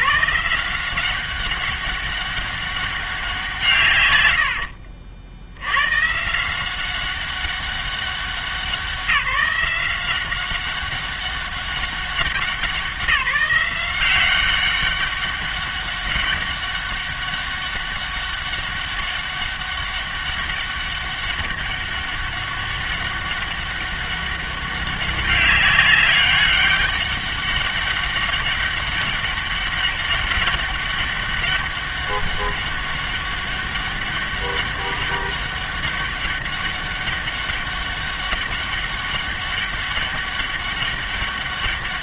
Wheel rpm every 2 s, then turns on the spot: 180, 200, 50, 180, 180, 190, 180, 190, 200, 200, 200, 200, 200, 200, 190, 200, 200, 200, 200, 200, 200.
4-6